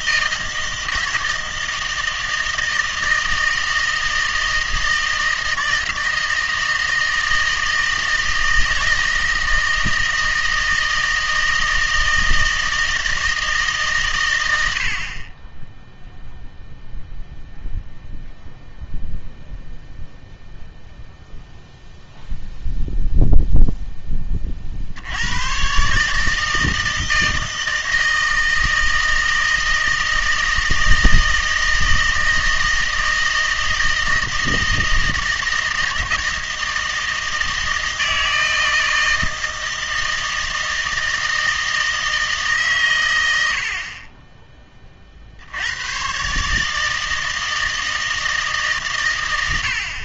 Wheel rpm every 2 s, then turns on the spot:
160, 160, 160, 160, 160, 160, 160, 80, 0, 0, 0, 0, 50, 160, 160, 160, 160, 160, 160, 160, 160, 130, 20, 150, 140.
none